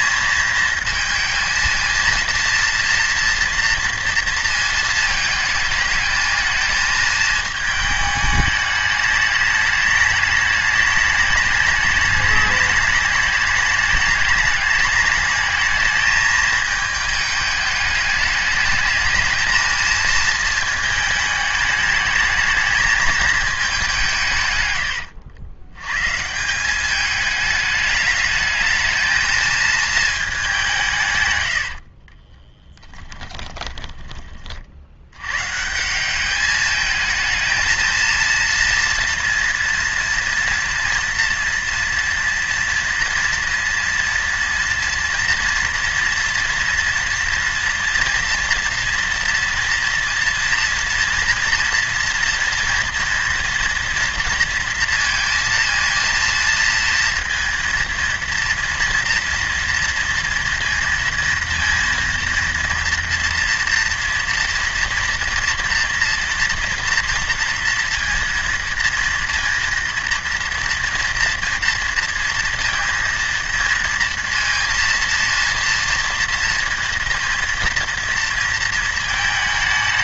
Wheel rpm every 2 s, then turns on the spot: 220, 230, 230, 220, 210, 210, 210, 210, 220, 210, 220, 220, 120, 180, 210, 180, 10, 50, 210, 230, 230, 230, 230, 230, 230, 230, 230, 230, 230, 240, 230, 230, 230, 230, 230, 240, 230, 230, 230, 230.
32-34